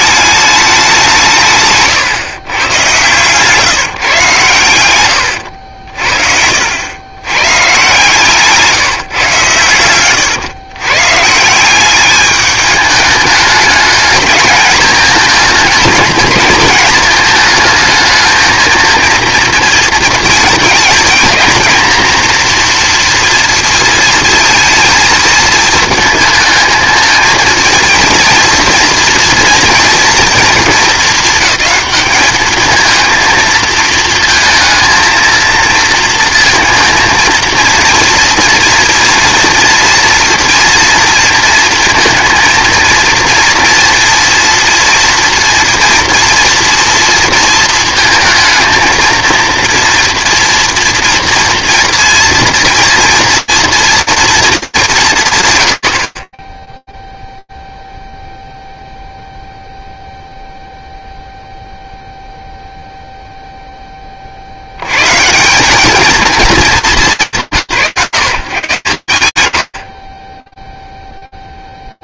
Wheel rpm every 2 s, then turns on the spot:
190, 120, 100, 90, 160, 130, 210, 210, 220, 230, 220, 240, 230, 220, 230, 200, 220, 230, 230, 230, 230, 230, 230, 230, 230, 230, 230, 200, 0, 0, 0, 0, 140, 180, 130, 10.
none